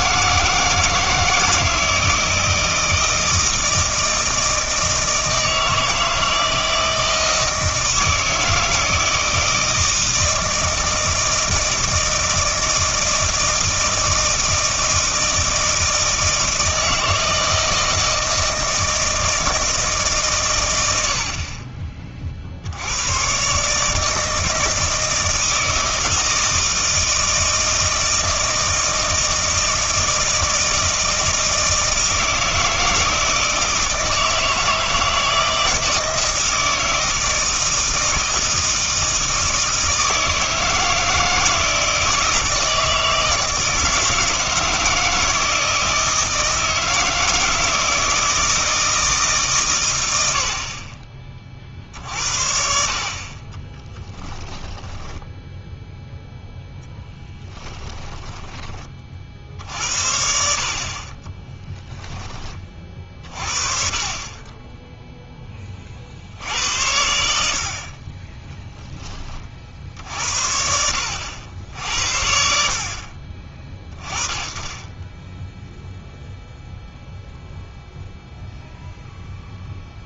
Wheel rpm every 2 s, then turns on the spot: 160, 160, 160, 160, 160, 160, 160, 160, 160, 160, 110, 80, 160, 160, 160, 160, 160, 160, 160, 160, 160, 160, 160, 160, 160, 50, 50, 10, 0, 20, 60, 30, 10, 80, 10, 70, 50, 20, 0, 0.
54-56 68-70